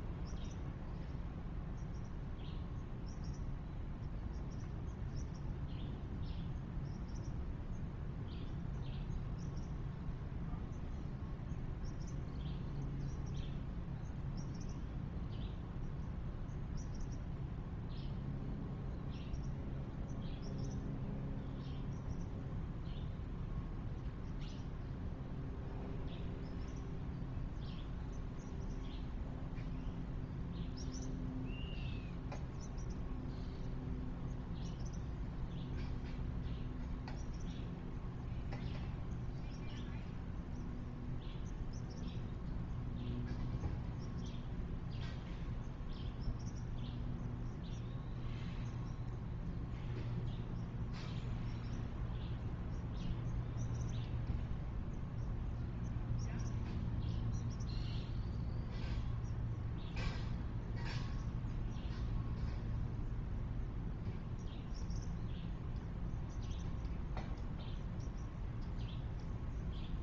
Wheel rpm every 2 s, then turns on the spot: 0, 0, 0, 0, 0, 0, 0, 0, 0, 0, 0, 0, 0, 0, 0, 0, 0, 0, 0, 0, 0, 0, 0, 0, 0, 0, 0, 0, 0, 0, 0, 0, 0, 0, 0.
none